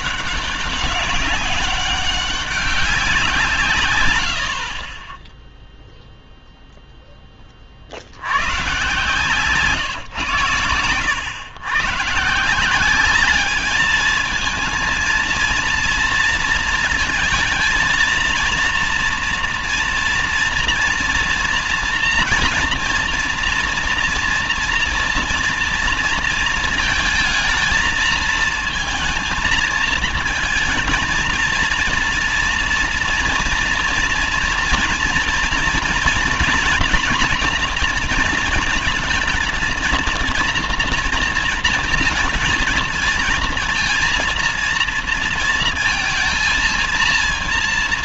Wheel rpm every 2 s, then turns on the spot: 200, 200, 70, 0, 110, 130, 180, 220, 230, 230, 230, 230, 230, 230, 220, 230, 230, 240, 250, 230, 230, 230, 230, 230.
none